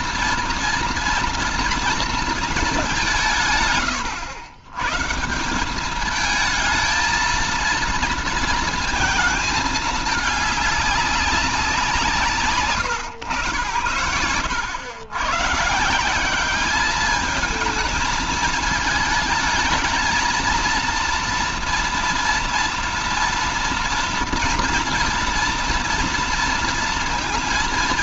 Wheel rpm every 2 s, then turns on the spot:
230, 220, 120, 220, 230, 200, 160, 100, 190, 220, 230, 230, 230, 230.
none